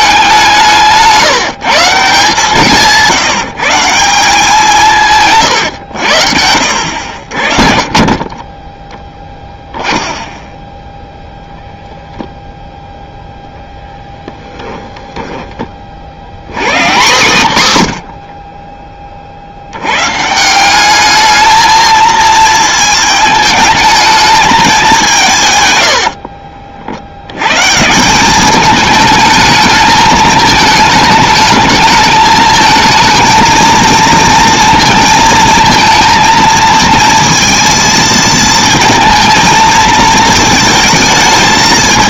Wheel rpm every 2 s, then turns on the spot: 170, 150, 170, 80, 20, 0, 0, 20, 150, 30, 180, 220, 200, 60, 210, 220, 220, 230, 230, 230, 230.
14-16